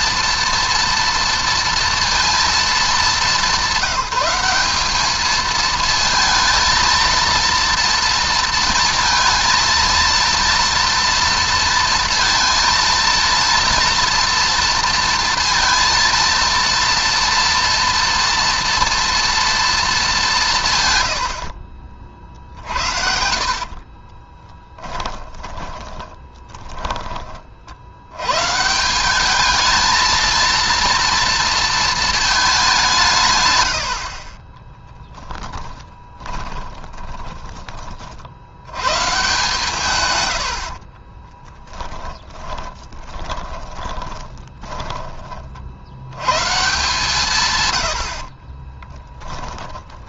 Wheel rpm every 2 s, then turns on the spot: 240, 220, 200, 230, 230, 230, 230, 230, 230, 230, 130, 60, 10, 20, 170, 230, 190, 20, 20, 100, 60, 20, 20, 130, 20.
22-26 34-38 40-46 48-50